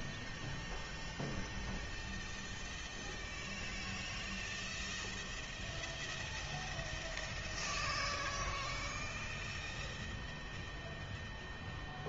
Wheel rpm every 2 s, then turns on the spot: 0, 0, 0, 0, 0, 0.
none